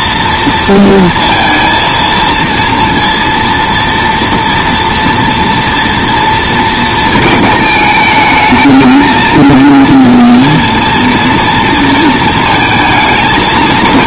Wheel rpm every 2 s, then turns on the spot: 230, 230, 230, 230, 220, 230, 230.
none